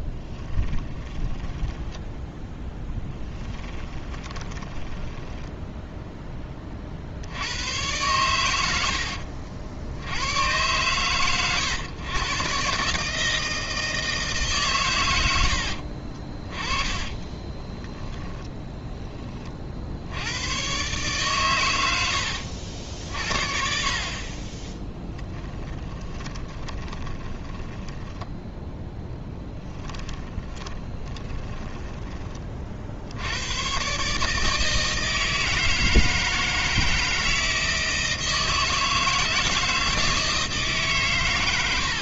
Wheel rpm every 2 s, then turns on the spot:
10, 10, 10, 40, 80, 120, 140, 130, 20, 10, 120, 60, 10, 20, 10, 20, 50, 160, 160, 160, 150.
0-6 16-18 24-32